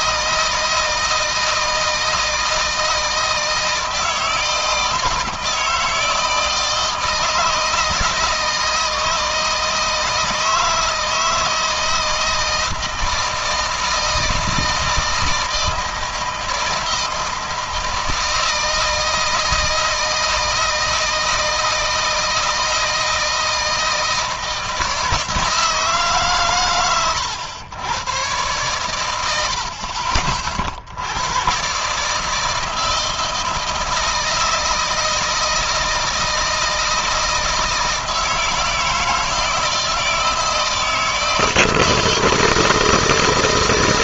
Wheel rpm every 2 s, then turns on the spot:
160, 160, 160, 160, 160, 160, 160, 160, 160, 160, 160, 160, 160, 120, 100, 80, 160, 160, 160, 160, 160, 160.
none